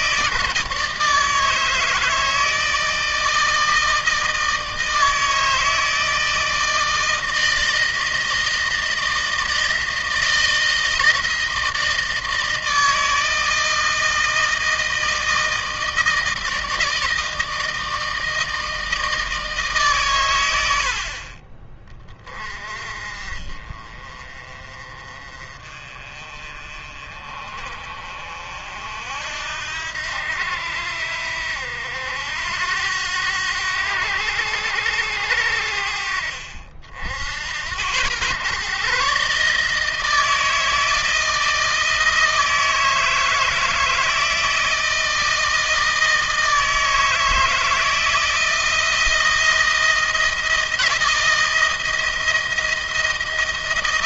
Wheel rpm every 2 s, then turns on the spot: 160, 160, 160, 160, 160, 160, 160, 160, 160, 160, 70, 30, 30, 40, 60, 80, 90, 90, 70, 130, 160, 160, 160, 160, 170, 160, 160.
none